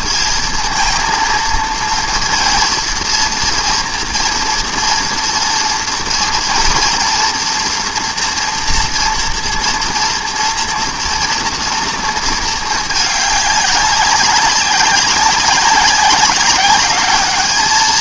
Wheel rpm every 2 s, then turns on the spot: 230, 230, 240, 240, 240, 230, 220, 200, 190.
none